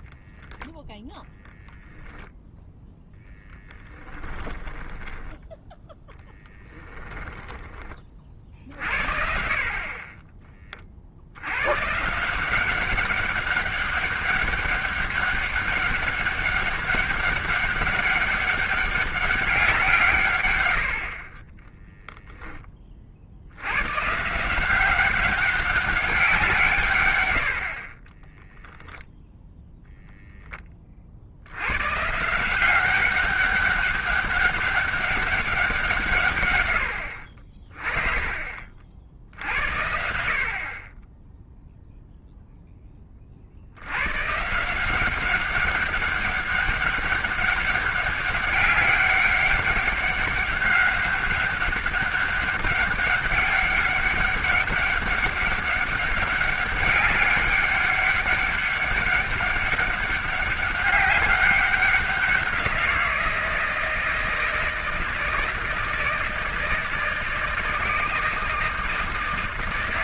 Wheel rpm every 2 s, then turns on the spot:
10, 10, 10, 10, 50, 40, 180, 200, 200, 200, 100, 30, 180, 150, 10, 20, 180, 200, 110, 40, 40, 0, 160, 200, 190, 190, 200, 200, 200, 200, 190, 180, 160, 160, 160.
0-2 4-8